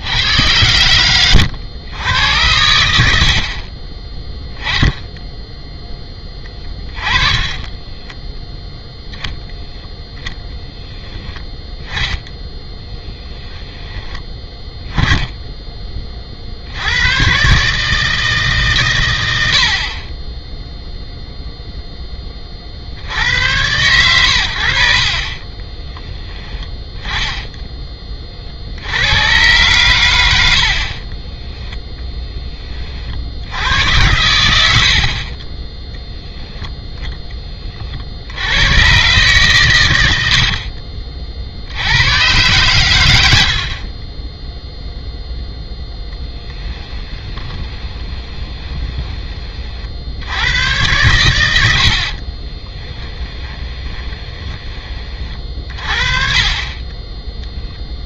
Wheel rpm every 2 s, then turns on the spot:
100, 90, 10, 20, 0, 0, 10, 10, 70, 140, 0, 40, 80, 10, 70, 50, 30, 70, 0, 100, 50, 110, 0, 10, 20, 100, 20, 20, 30.
6-8 12-14 30-32 40-42 46-50 52-54